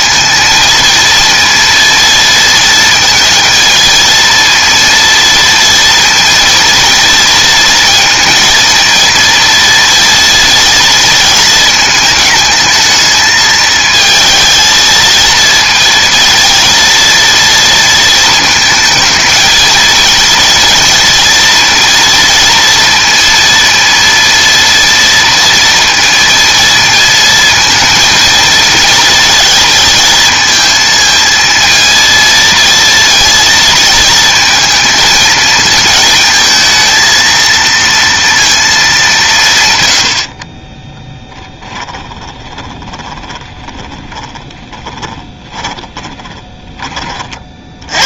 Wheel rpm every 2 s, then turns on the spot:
230, 230, 230, 240, 230, 230, 220, 230, 230, 220, 230, 230, 230, 230, 230, 220, 230, 230, 230, 220, 30, 20, 20, 20.
40-46